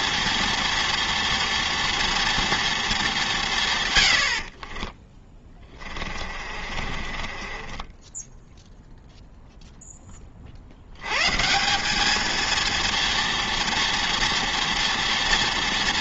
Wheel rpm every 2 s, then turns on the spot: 230, 220, 30, 30, 0, 70, 230, 240.
4-8